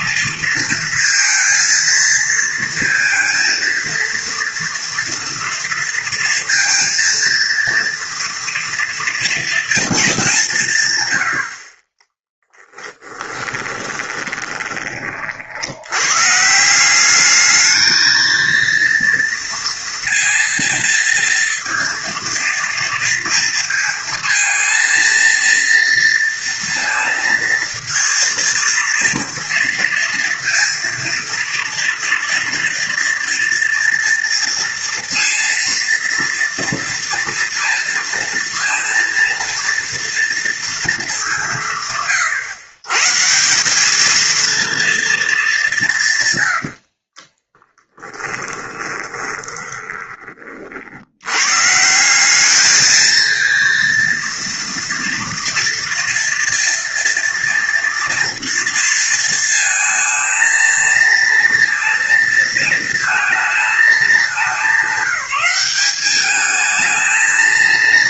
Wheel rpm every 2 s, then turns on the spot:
230, 230, 230, 230, 230, 140, 10, 20, 170, 230, 230, 230, 230, 230, 230, 230, 230, 230, 230, 230, 230, 130, 230, 90, 20, 50, 210, 230, 230, 230, 230, 220, 190, 220.
12-14 46-50